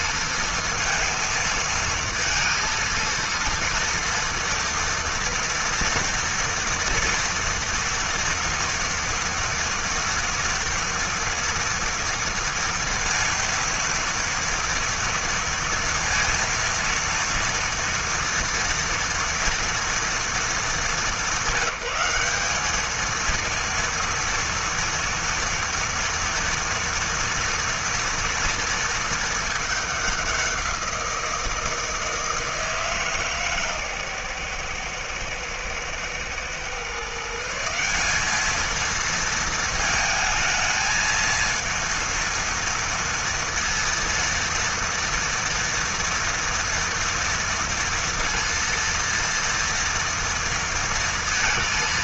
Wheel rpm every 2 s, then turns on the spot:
230, 230, 230, 240, 230, 230, 230, 230, 230, 230, 200, 230, 230, 230, 210, 160, 130, 120, 180, 220, 230, 230, 230, 230, 230, 230.
none